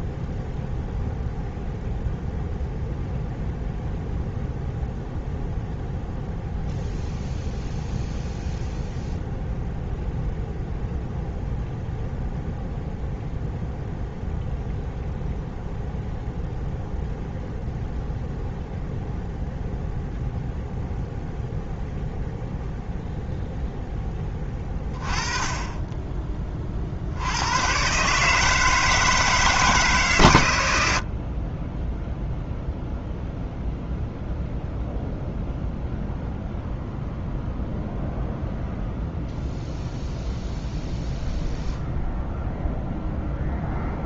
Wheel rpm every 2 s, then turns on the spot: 0, 0, 0, 0, 0, 0, 0, 0, 0, 0, 0, 0, 20, 50, 160, 90, 0, 0, 0, 0, 0, 0.
none